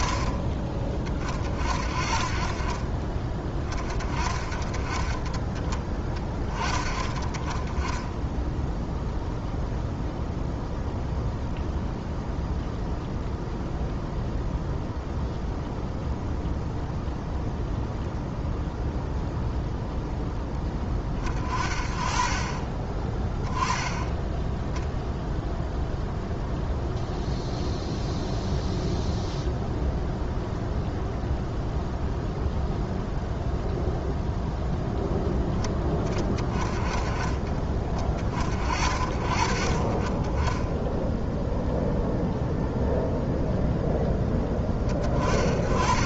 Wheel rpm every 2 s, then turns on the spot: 40, 40, 30, 20, 0, 0, 0, 0, 0, 0, 20, 30, 0, 0, 0, 0, 0, 0, 20, 50, 10, 0, 20.
none